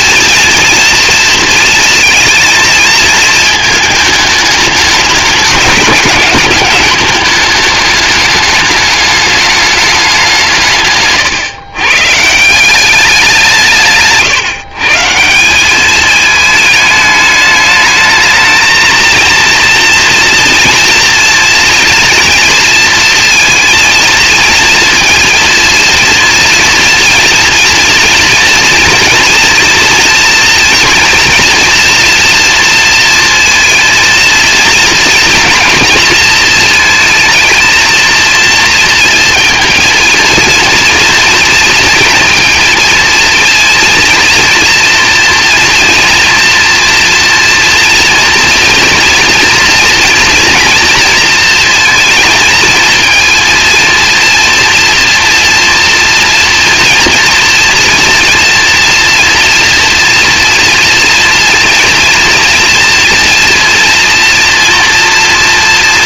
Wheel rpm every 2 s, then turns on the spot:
230, 220, 210, 210, 210, 140, 190, 210, 210, 230, 230, 230, 230, 230, 230, 230, 230, 230, 230, 230, 230, 230, 230, 230, 240, 230, 230, 240, 240, 230, 230, 240, 240.
none